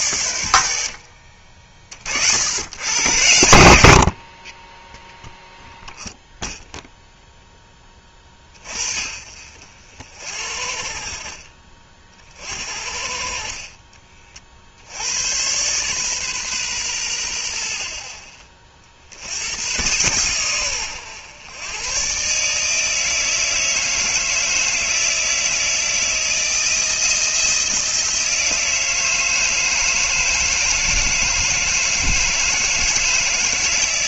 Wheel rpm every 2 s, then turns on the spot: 90, 90, 30, 0, 30, 60, 50, 60, 130, 40, 110, 150, 160, 170, 160, 160, 160.
none